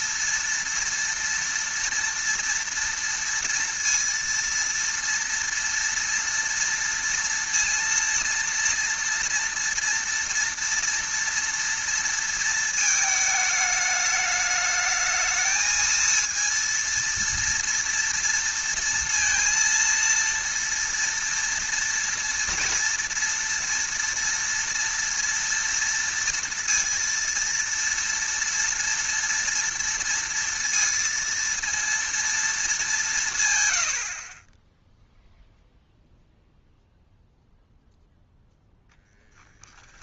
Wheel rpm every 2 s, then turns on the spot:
230, 230, 230, 230, 230, 230, 230, 210, 230, 230, 230, 230, 230, 230, 230, 230, 220, 20, 0, 10.
none